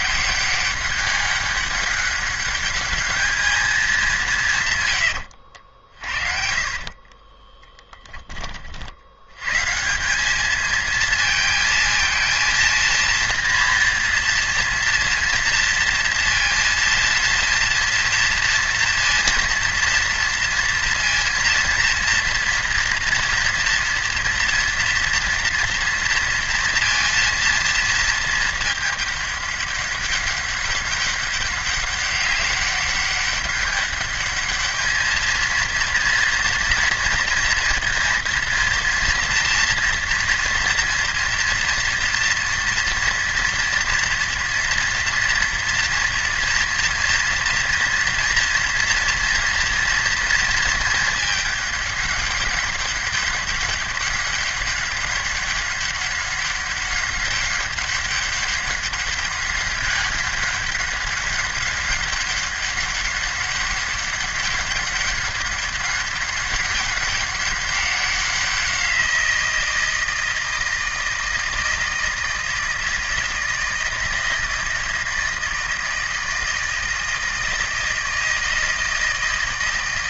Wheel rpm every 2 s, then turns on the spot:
190, 210, 150, 40, 40, 220, 230, 230, 230, 230, 230, 230, 230, 230, 220, 200, 200, 210, 230, 230, 230, 230, 230, 230, 230, 220, 200, 200, 200, 200, 200, 200, 200, 200, 180, 160, 160, 160, 160, 160.
6-8